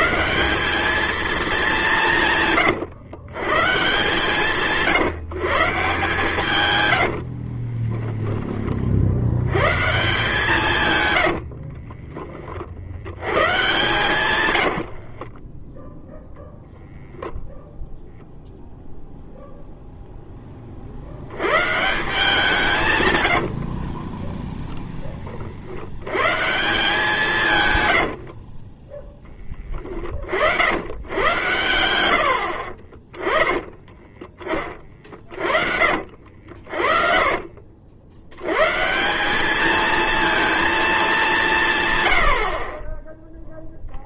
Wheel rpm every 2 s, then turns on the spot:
210, 120, 140, 60, 70, 90, 100, 50, 0, 0, 70, 120, 20, 160, 10, 90, 40, 30, 50, 120, 220, 40.
6-8 10-12 14-16 28-30 32-34 36-38